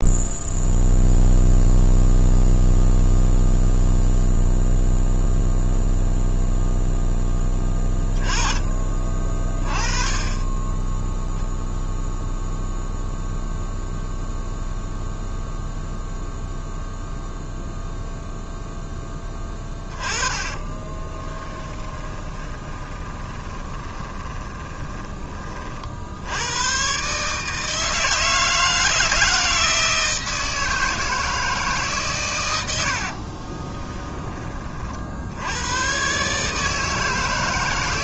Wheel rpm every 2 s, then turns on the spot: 0, 0, 0, 0, 20, 20, 0, 0, 0, 0, 20, 20, 20, 110, 160, 160, 100, 30, 150.
20-26